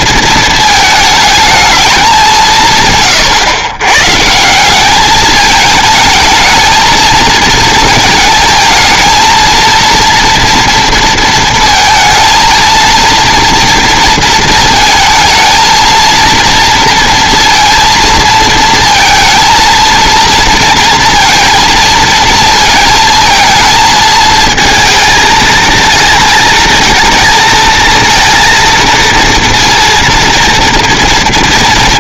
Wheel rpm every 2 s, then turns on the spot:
220, 150, 190, 220, 220, 230, 230, 230, 230, 220, 230, 230, 230, 220, 230, 230.
none